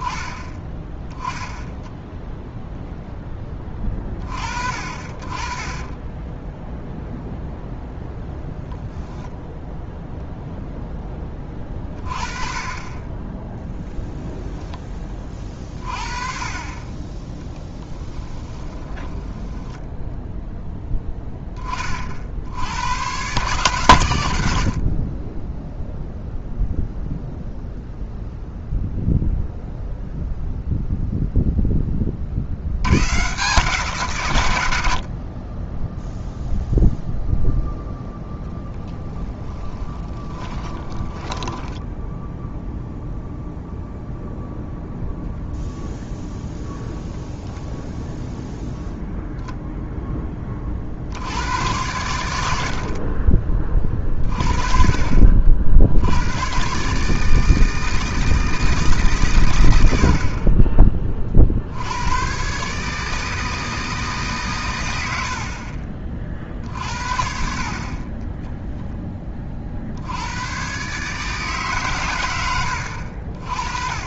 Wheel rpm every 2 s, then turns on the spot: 10, 0, 40, 0, 0, 0, 20, 10, 30, 10, 10, 90, 60, 0, 0, 0, 90, 90, 0, 10, 20, 0, 0, 0, 0, 50, 60, 30, 130, 160, 30, 140, 120, 50, 10, 130, 80.
18-20 40-42